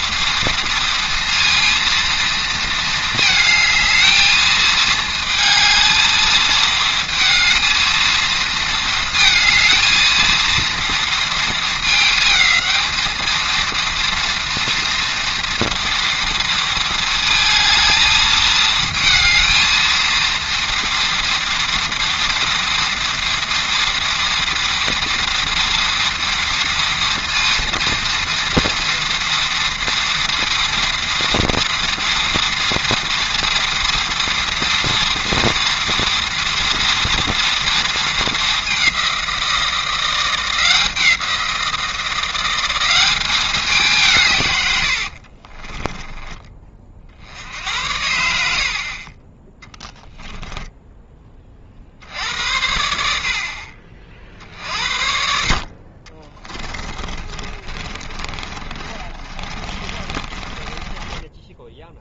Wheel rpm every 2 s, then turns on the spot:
230, 230, 220, 220, 230, 230, 220, 230, 230, 220, 230, 230, 230, 230, 230, 230, 230, 230, 230, 210, 170, 180, 130, 20, 70, 10, 80, 50, 20, 30, 20.
50-52 56-62